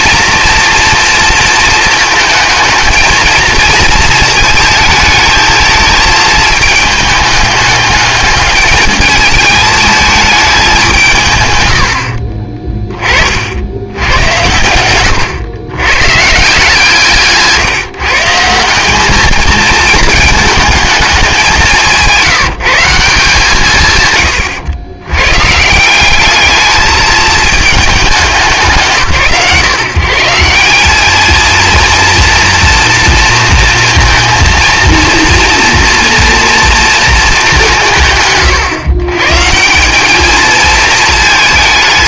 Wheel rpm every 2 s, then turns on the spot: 230, 220, 220, 220, 210, 190, 30, 100, 150, 180, 220, 150, 110, 210, 140, 180, 230, 230, 240, 120, 220.
12-14